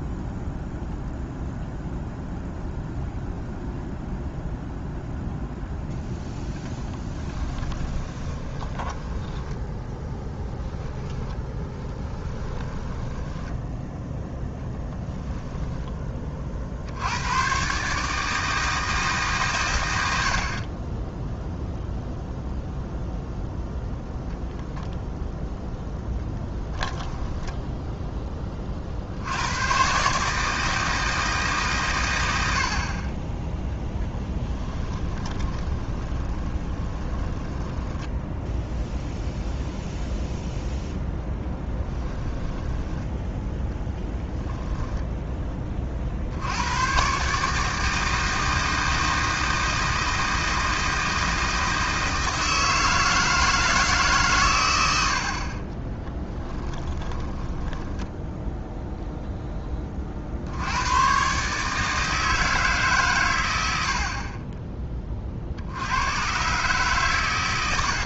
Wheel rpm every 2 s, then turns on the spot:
0, 0, 0, 10, 10, 10, 10, 10, 70, 160, 20, 0, 0, 10, 40, 160, 40, 20, 20, 0, 0, 10, 10, 120, 160, 160, 160, 90, 20, 0, 100, 140, 20, 130.
6-14 26-28 34-38 42-44 56-58